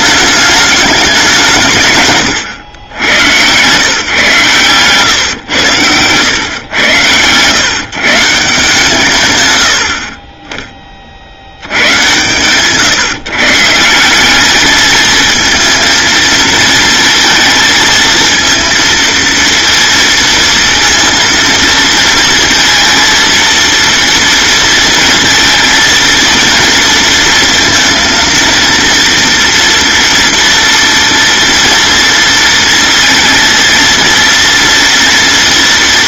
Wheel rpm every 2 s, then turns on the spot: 200, 100, 130, 110, 150, 30, 140, 210, 230, 230, 230, 230, 230, 230, 230, 230, 230, 230.
4-6